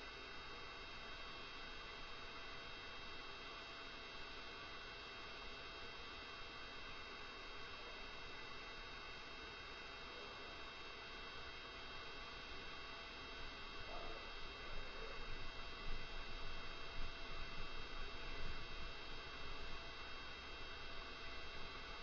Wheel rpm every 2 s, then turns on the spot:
0, 0, 0, 0, 0, 0, 0, 0, 0, 0, 0.
none